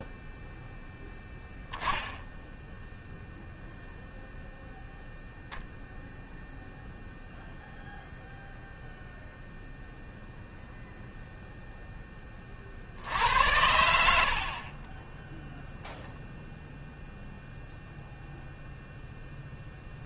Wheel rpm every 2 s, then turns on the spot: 0, 0, 0, 0, 0, 0, 60, 30, 0, 0.
14-16